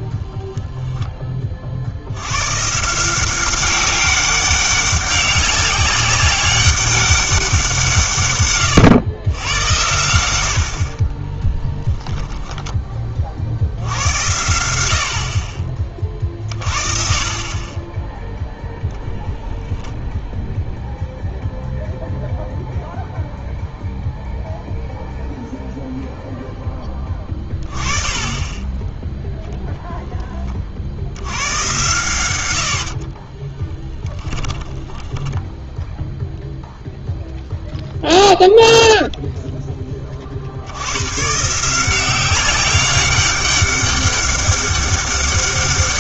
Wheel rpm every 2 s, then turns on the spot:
0, 130, 200, 200, 120, 70, 20, 90, 30, 10, 0, 0, 0, 10, 20, 40, 80, 10, 0, 0, 80, 190, 200.
28-30 34-36